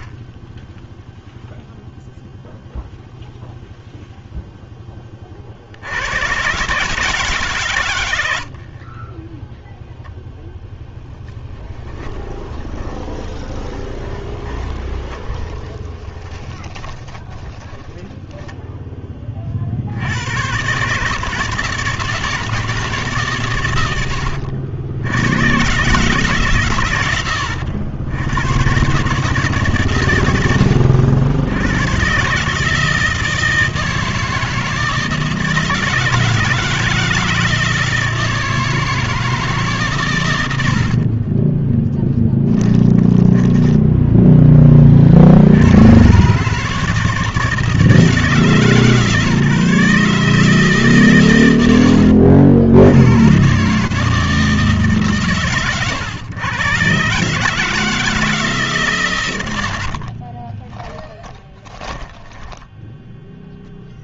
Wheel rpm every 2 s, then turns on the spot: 10, 0, 0, 140, 70, 0, 20, 20, 20, 0, 110, 160, 80, 140, 110, 90, 150, 160, 160, 160, 90, 10, 10, 150, 150, 150, 60, 160, 120, 150, 30, 10.
12-18 42-44 60-64